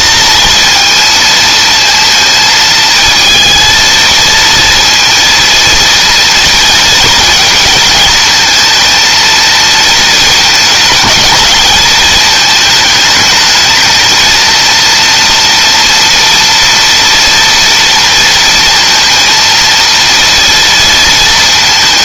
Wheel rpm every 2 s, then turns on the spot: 230, 230, 230, 230, 230, 220, 220, 230, 230, 230, 230.
none